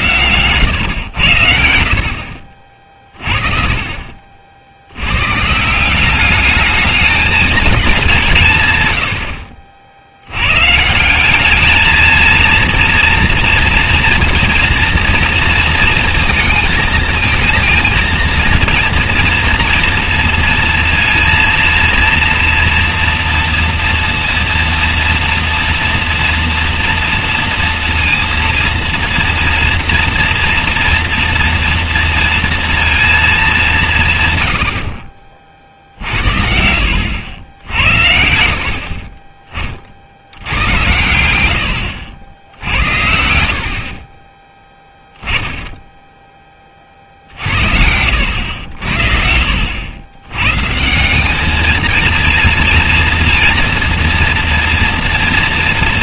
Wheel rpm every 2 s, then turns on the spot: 120, 40, 60, 210, 140, 130, 230, 230, 230, 230, 230, 240, 230, 230, 230, 240, 230, 100, 70, 50, 100, 80, 10, 30, 90, 140, 240, 230.
44-46